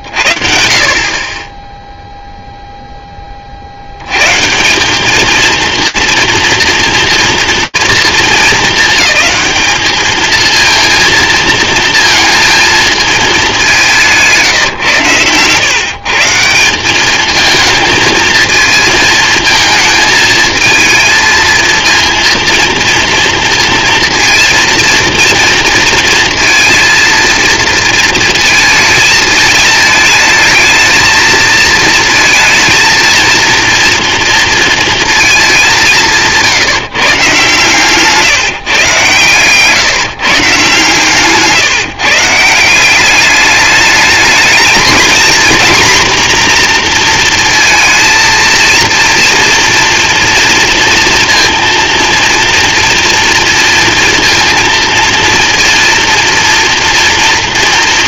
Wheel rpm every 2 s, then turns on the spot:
60, 0, 150, 230, 220, 220, 230, 160, 160, 220, 220, 230, 230, 230, 220, 220, 230, 230, 160, 140, 140, 160, 220, 250, 230, 230, 230, 230, 230.
none